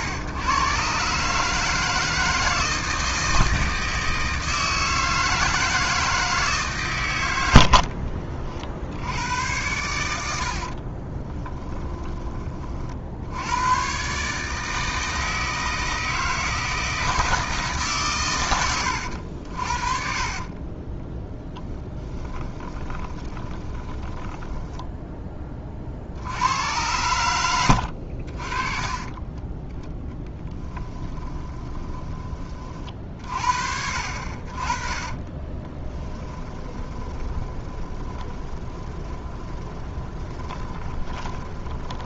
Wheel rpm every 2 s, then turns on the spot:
140, 160, 160, 120, 70, 30, 50, 160, 160, 90, 20, 20, 10, 100, 20, 10, 40, 30, 20, 20, 20.
10-12 22-24 30-32 34-42